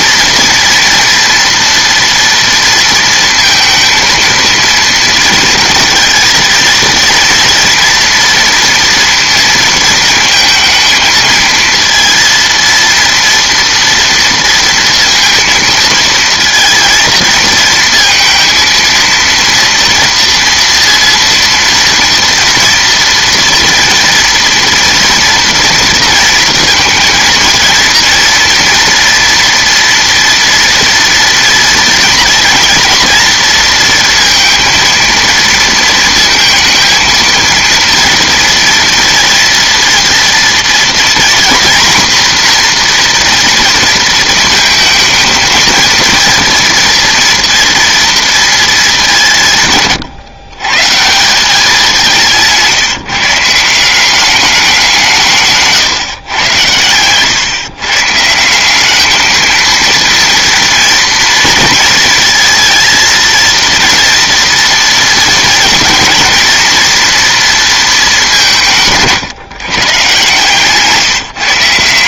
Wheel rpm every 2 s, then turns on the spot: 230, 230, 230, 230, 230, 220, 230, 230, 230, 230, 230, 230, 230, 230, 230, 230, 230, 230, 230, 230, 230, 240, 220, 230, 210, 130, 170, 200, 110, 200, 230, 230, 230, 230, 180, 140.
none